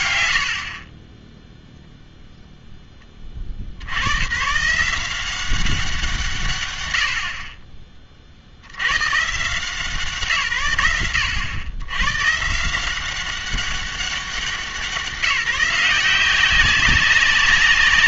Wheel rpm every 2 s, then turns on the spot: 100, 10, 150, 110, 100, 110, 160, 180, 190.
none